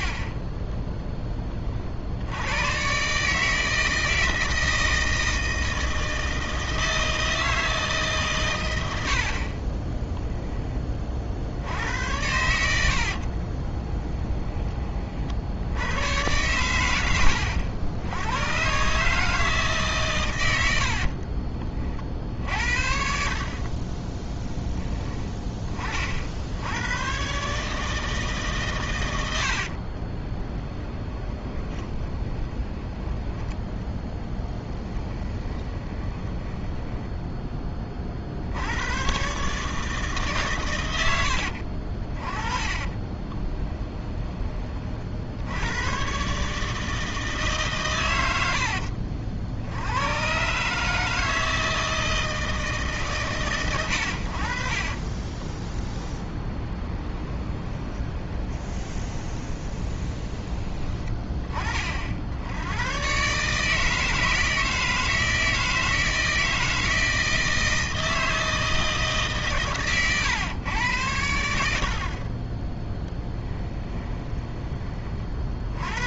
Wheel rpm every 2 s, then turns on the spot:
10, 130, 160, 160, 90, 30, 80, 30, 100, 140, 70, 60, 10, 110, 110, 30, 20, 20, 10, 100, 100, 20, 40, 160, 70, 150, 150, 30, 20, 20, 20, 110, 160, 160, 160, 110, 10, 30.
12-14 20-22 24-26 30-38 42-44 54-60